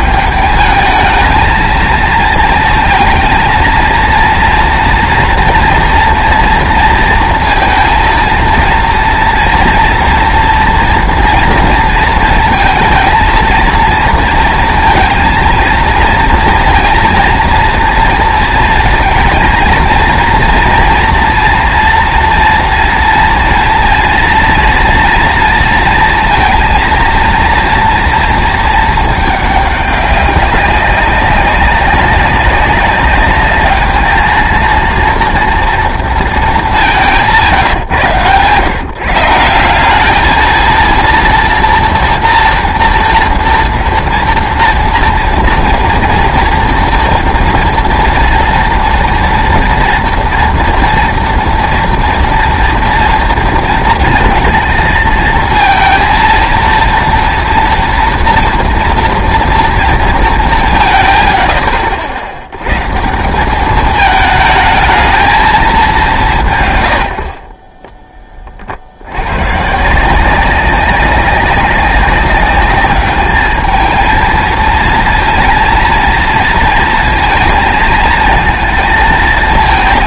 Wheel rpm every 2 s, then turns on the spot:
210, 230, 230, 230, 230, 230, 230, 230, 230, 230, 230, 230, 240, 230, 230, 200, 200, 230, 210, 130, 220, 230, 230, 230, 230, 230, 230, 230, 230, 230, 170, 130, 210, 120, 50, 190, 200, 230, 230, 220.
none